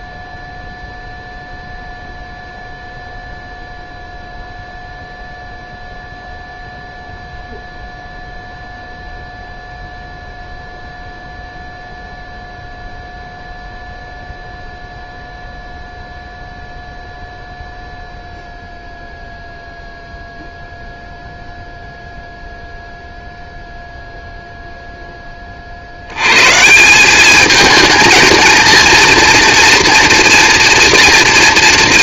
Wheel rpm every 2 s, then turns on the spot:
0, 0, 0, 0, 0, 0, 0, 0, 0, 0, 0, 0, 0, 150, 220, 230.
none